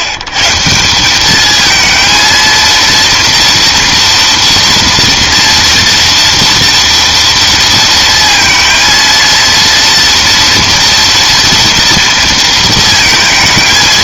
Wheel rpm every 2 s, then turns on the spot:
150, 230, 230, 230, 230, 230, 230.
none